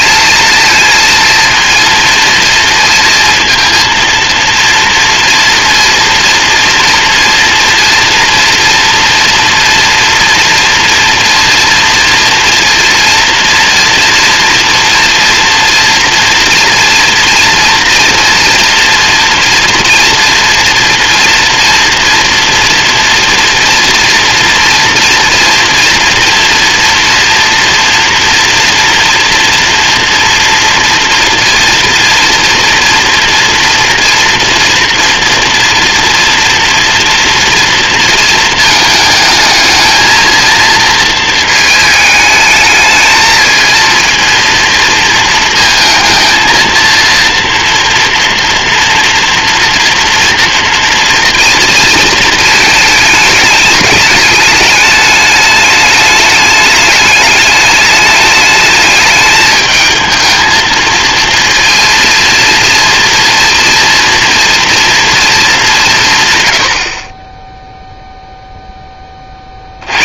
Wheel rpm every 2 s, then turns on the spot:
230, 230, 240, 230, 230, 230, 230, 230, 230, 230, 230, 230, 230, 230, 230, 230, 230, 240, 230, 220, 230, 220, 230, 230, 230, 230, 220, 210, 210, 210, 220, 230, 230, 80, 10.
none